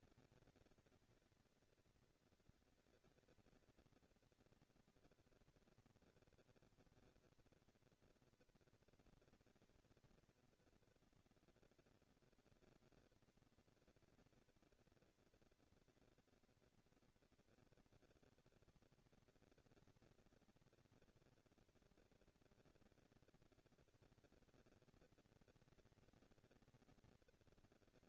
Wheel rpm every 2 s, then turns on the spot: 220, 220, 230, 230, 230, 230, 230, 230, 230, 200, 200, 220, 230, 230.
none